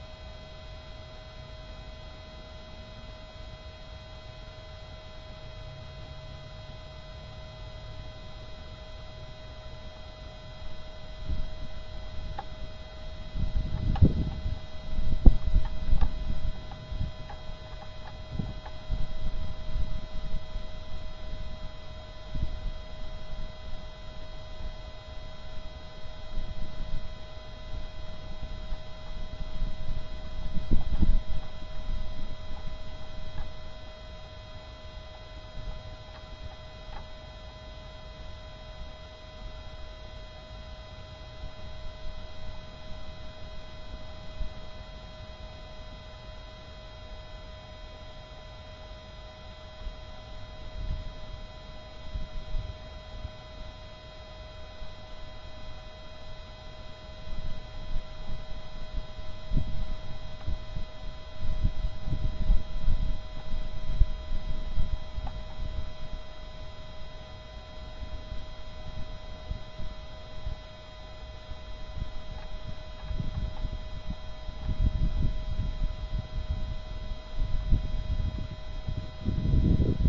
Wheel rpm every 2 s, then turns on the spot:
0, 0, 0, 0, 0, 0, 0, 0, 0, 0, 0, 0, 0, 0, 0, 0, 0, 0, 0, 0, 0, 0, 0, 0, 0, 0, 0, 0, 0, 0, 0, 0, 0, 0, 0, 0, 0, 0, 0, 0.
none